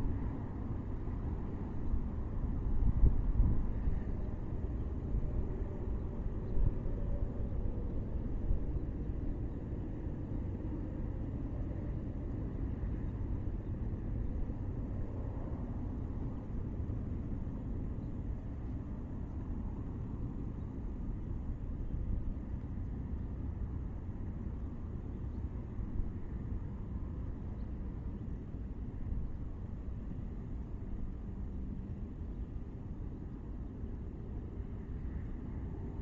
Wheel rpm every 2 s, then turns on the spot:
0, 0, 0, 0, 0, 0, 0, 0, 0, 0, 0, 0, 0, 0, 0, 0, 0, 0.
none